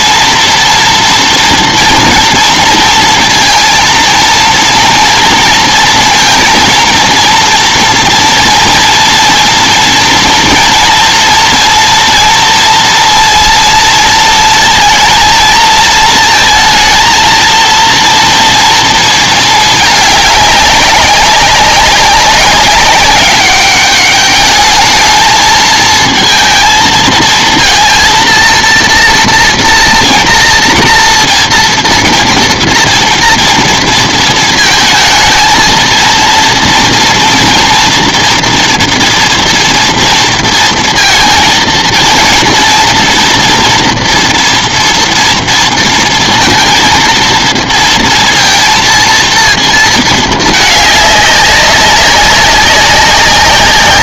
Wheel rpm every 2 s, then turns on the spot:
240, 230, 230, 230, 230, 230, 230, 230, 230, 230, 200, 190, 210, 230, 230, 230, 230, 220, 240, 230, 230, 230, 230, 230, 230, 210, 190.
none